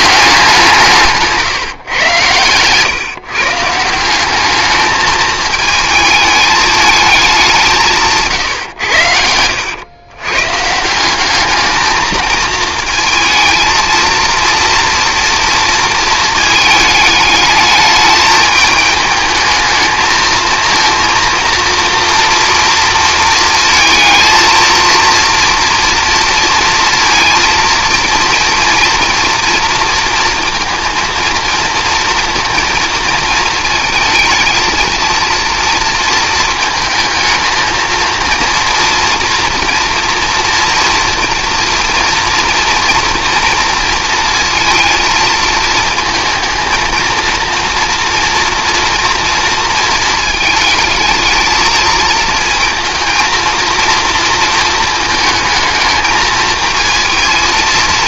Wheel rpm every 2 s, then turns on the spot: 160, 140, 220, 210, 90, 180, 220, 230, 210, 210, 240, 230, 230, 230, 230, 230, 230, 230, 220, 230, 230, 230, 230, 230, 240, 220, 230, 220, 220.
none